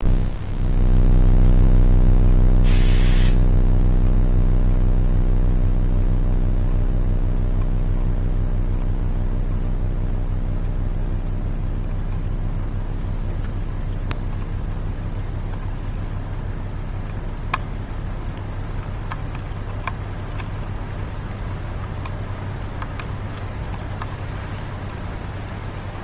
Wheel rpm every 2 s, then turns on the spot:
0, 0, 0, 0, 0, 0, 0, 0, 0, 0, 0, 0, 0.
none